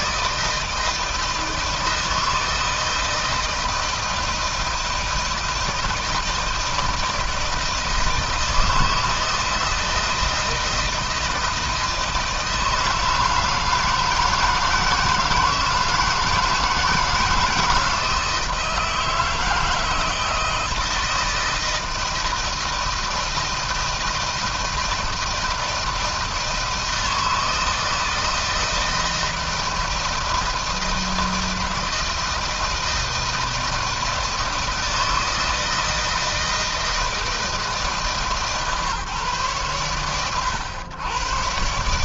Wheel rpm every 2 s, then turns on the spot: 160, 160, 160, 160, 160, 170, 160, 170, 160, 160, 170, 160, 160, 160, 160, 160, 160, 160, 160, 130, 110.
none